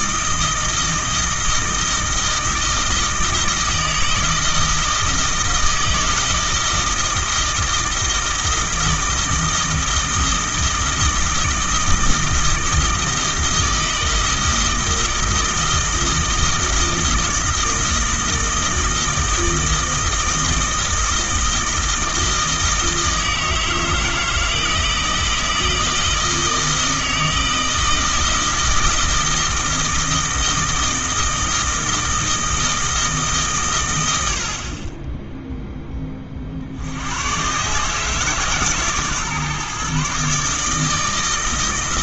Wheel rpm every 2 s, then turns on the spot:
160, 160, 160, 160, 160, 160, 160, 160, 160, 160, 160, 160, 160, 160, 160, 160, 160, 40, 60, 150, 150.
none